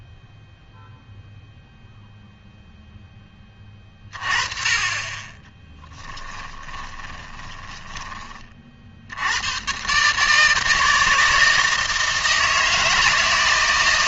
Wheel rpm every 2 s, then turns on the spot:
0, 0, 30, 30, 40, 160, 160.
6-8